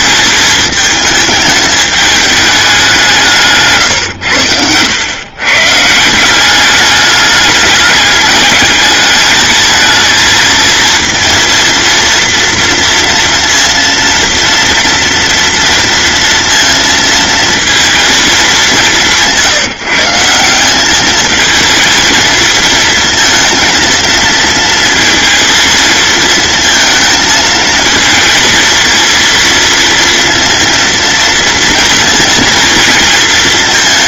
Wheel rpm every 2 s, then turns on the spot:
210, 190, 100, 200, 210, 230, 230, 230, 230, 190, 190, 220, 230, 220, 230, 230, 230.
none